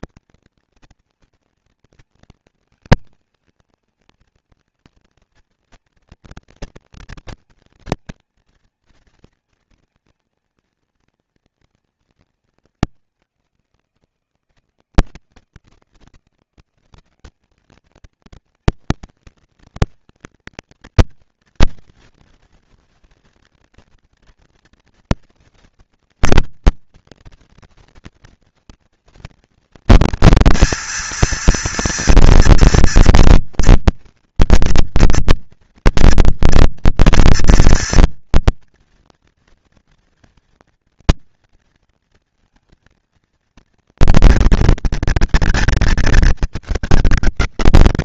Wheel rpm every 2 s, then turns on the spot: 240, 230, 230, 230, 230, 230, 220, 160, 180, 240, 240, 230, 230, 230, 230, 230, 230, 230, 230, 230, 230, 230, 230, 210.
none